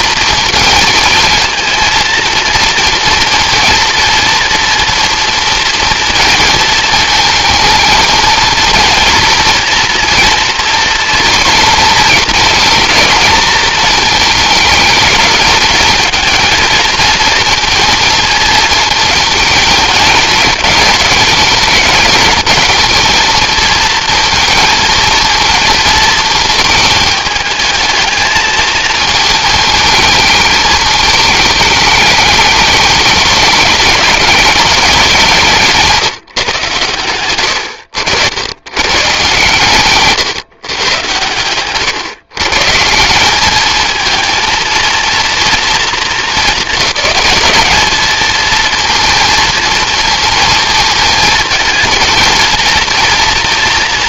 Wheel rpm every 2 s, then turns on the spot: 230, 230, 230, 230, 240, 230, 220, 220, 220, 220, 210, 220, 230, 220, 220, 220, 210, 190, 130, 110, 130, 150, 230, 210, 230, 220, 230.
none